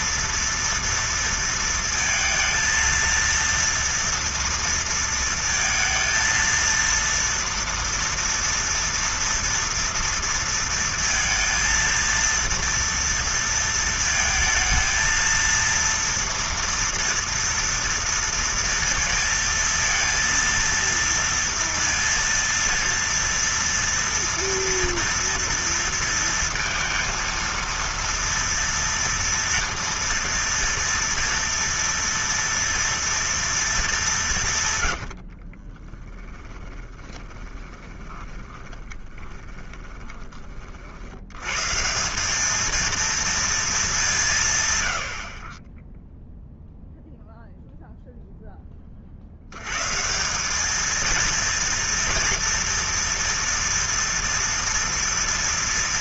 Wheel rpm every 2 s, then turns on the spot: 230, 230, 230, 230, 230, 230, 230, 220, 230, 230, 230, 230, 230, 230, 230, 230, 230, 150, 20, 10, 40, 220, 130, 0, 30, 210, 230, 230.
34-40